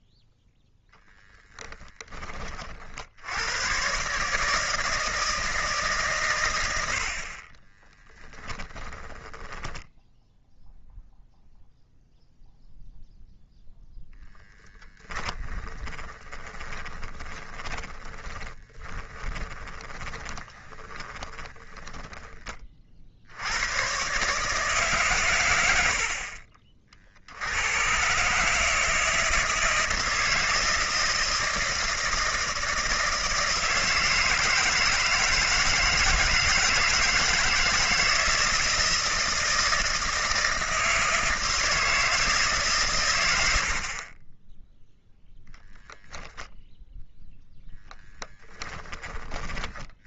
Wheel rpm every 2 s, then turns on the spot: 0, 40, 160, 80, 10, 0, 0, 10, 20, 20, 20, 50, 140, 60, 160, 160, 160, 160, 160, 160, 160, 130, 0, 0, 20.
8-10 14-22